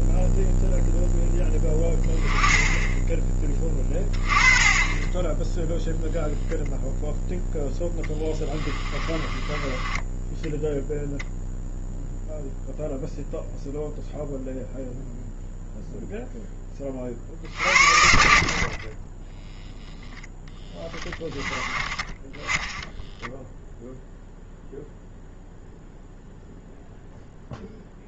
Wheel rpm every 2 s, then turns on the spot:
0, 20, 30, 0, 20, 0, 0, 0, 40, 30, 10, 10, 0, 0.
8-10